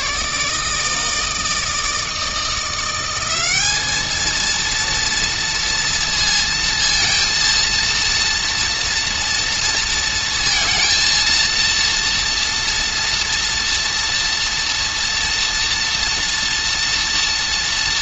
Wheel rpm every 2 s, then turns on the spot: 160, 180, 230, 230, 230, 230, 230, 230, 240.
none